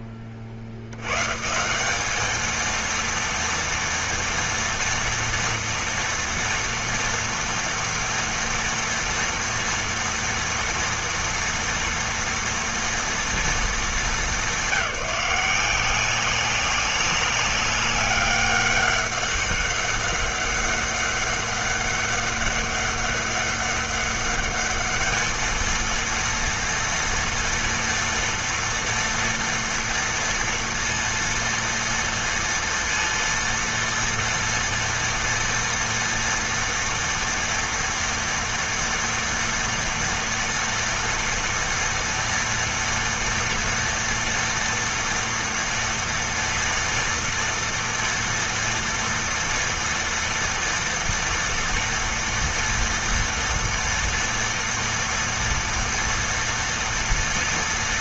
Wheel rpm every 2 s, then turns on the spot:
80, 230, 240, 230, 230, 230, 230, 200, 200, 200, 200, 200, 220, 230, 230, 230, 230, 230, 240, 230, 240, 230, 230, 230, 240, 230, 230, 230, 230.
none